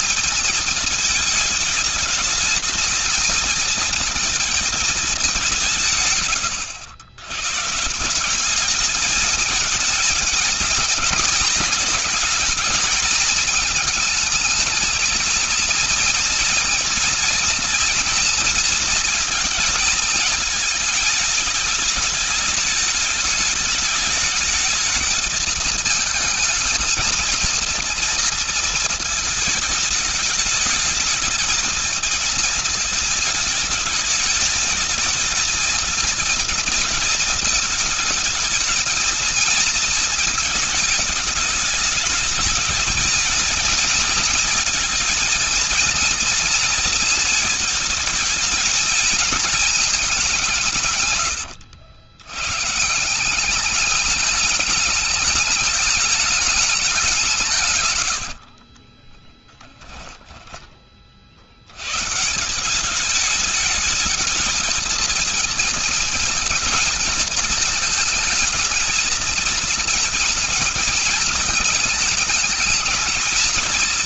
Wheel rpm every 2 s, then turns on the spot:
220, 220, 220, 90, 200, 230, 220, 220, 230, 230, 220, 210, 220, 220, 220, 220, 230, 220, 230, 220, 220, 220, 240, 230, 220, 170, 110, 210, 210, 50, 10, 170, 230, 220, 220, 220, 220.
58-60